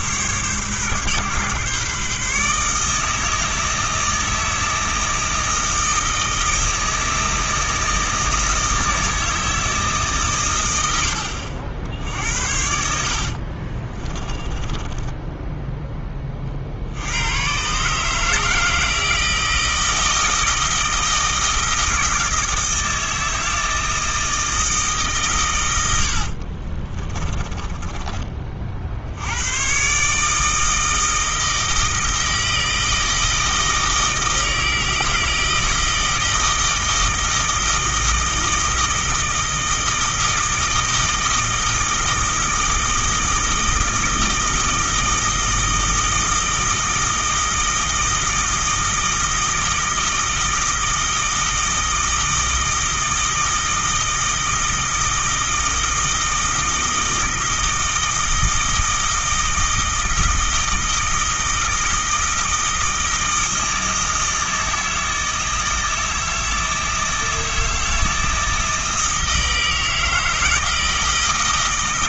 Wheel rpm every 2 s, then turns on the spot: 140, 150, 160, 160, 160, 100, 80, 20, 50, 160, 160, 160, 160, 40, 40, 160, 160, 160, 160, 160, 160, 160, 160, 160, 160, 160, 160, 160, 160, 160, 160, 160, 160, 160, 160, 160.
12-16 26-28